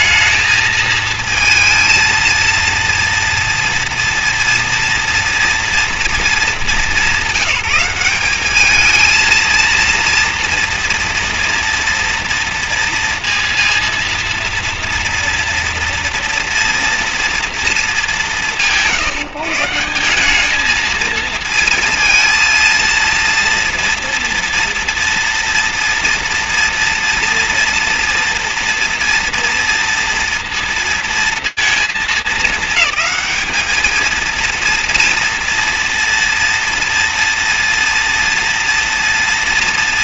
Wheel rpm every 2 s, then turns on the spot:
220, 230, 240, 220, 210, 230, 230, 230, 230, 170, 210, 230, 230, 230, 230, 230, 210, 230, 240, 230.
none